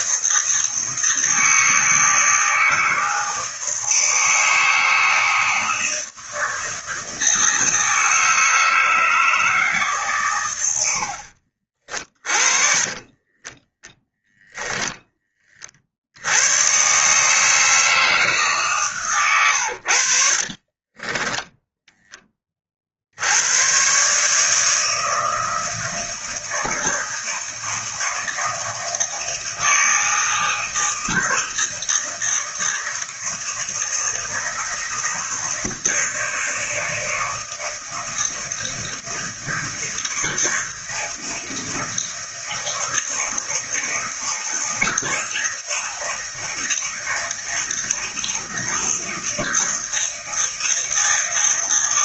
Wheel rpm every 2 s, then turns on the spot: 160, 160, 160, 160, 160, 90, 30, 10, 120, 140, 40, 50, 160, 160, 160, 160, 160, 160, 160, 160, 160, 160, 160, 160, 160, 160.
12-14 20-22